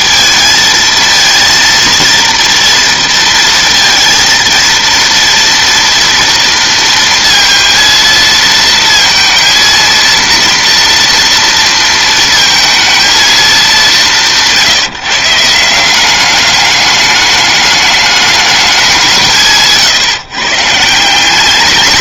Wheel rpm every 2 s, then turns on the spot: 220, 230, 230, 230, 230, 230, 230, 160, 210, 180, 160.
none